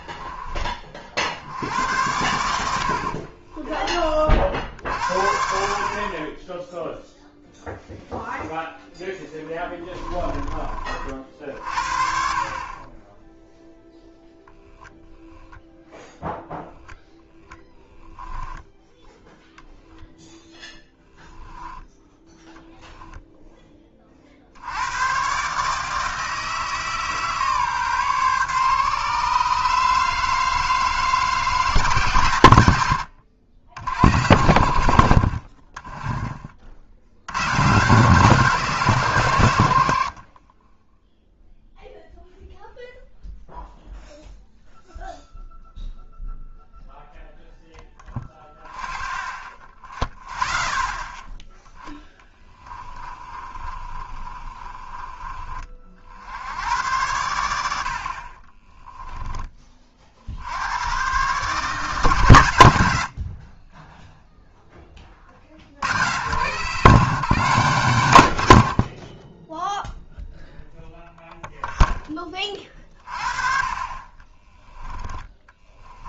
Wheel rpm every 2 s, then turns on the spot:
30, 80, 60, 10, 0, 30, 30, 0, 0, 0, 10, 0, 80, 160, 140, 160, 100, 80, 60, 160, 10, 0, 0, 0, 0, 0, 20, 30, 90, 20, 90, 100, 10, 150, 70, 0, 30, 10.
20-22 52-56 58-60 68-70 74-76